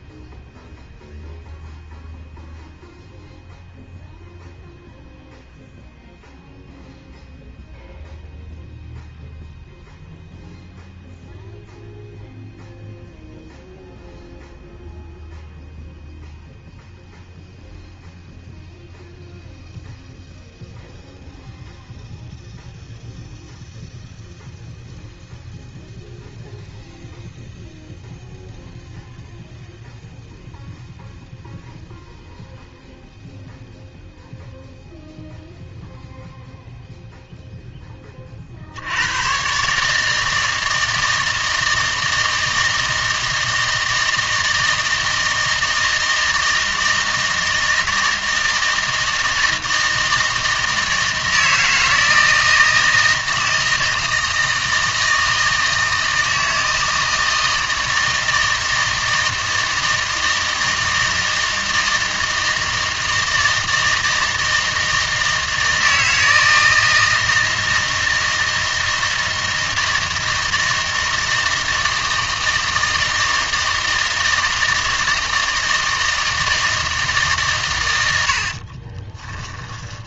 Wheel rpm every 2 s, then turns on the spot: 0, 0, 0, 0, 0, 0, 0, 0, 0, 0, 0, 0, 0, 0, 0, 0, 0, 0, 0, 60, 160, 160, 160, 160, 160, 160, 160, 160, 160, 160, 160, 160, 160, 160, 160, 160, 160, 160, 160, 50.
78-80